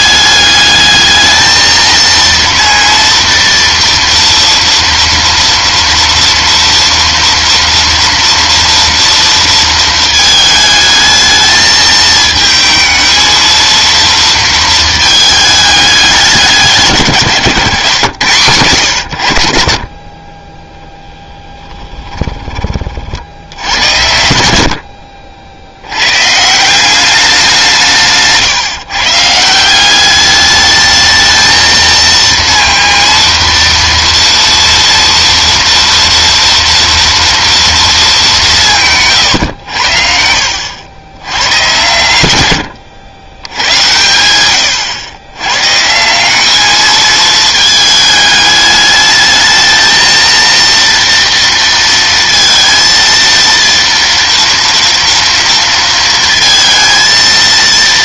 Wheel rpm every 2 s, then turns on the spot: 210, 230, 230, 230, 240, 220, 220, 230, 170, 100, 10, 20, 70, 160, 150, 210, 230, 230, 230, 190, 80, 100, 100, 210, 210, 230, 230, 230, 230.
20-22